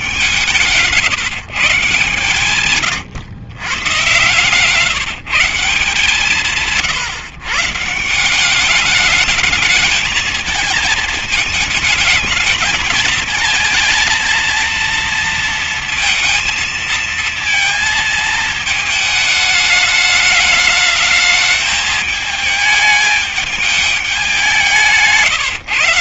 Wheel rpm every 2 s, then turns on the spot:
180, 130, 150, 160, 190, 220, 220, 230, 220, 220, 210, 220, 190.
2-4